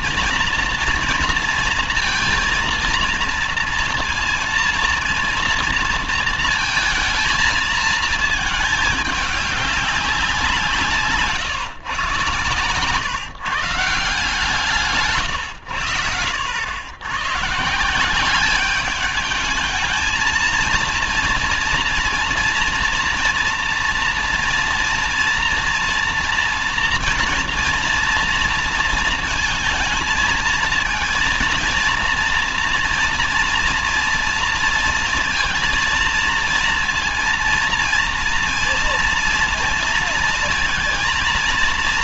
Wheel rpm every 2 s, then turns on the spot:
230, 230, 230, 220, 220, 170, 130, 160, 90, 190, 220, 230, 230, 230, 230, 230, 230, 230, 230, 230, 230.
none